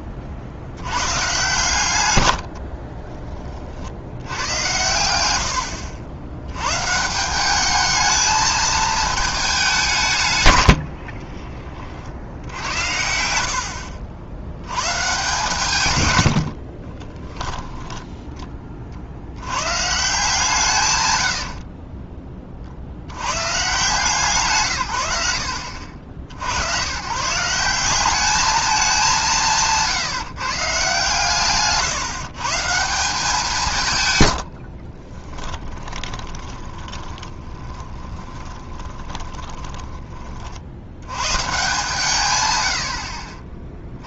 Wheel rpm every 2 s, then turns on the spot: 80, 50, 90, 120, 220, 80, 80, 100, 60, 40, 140, 50, 130, 120, 210, 150, 160, 60, 20, 20, 60, 100.
2-4 10-12 16-18 34-40